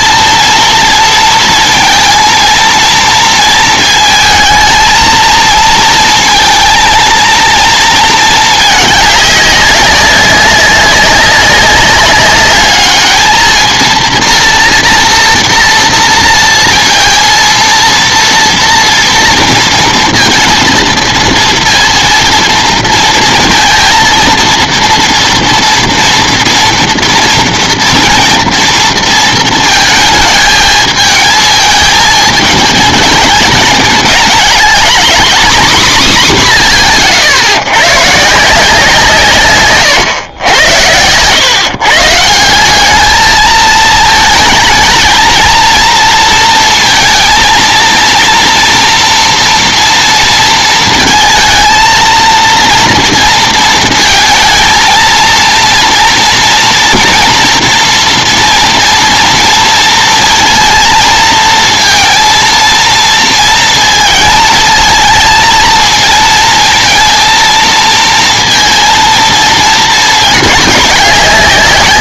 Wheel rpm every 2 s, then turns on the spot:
230, 230, 230, 230, 210, 190, 210, 230, 230, 230, 230, 230, 230, 230, 230, 220, 210, 220, 180, 160, 90, 180, 220, 230, 230, 230, 230, 230, 230, 230, 230, 230, 230, 230, 230, 210.
none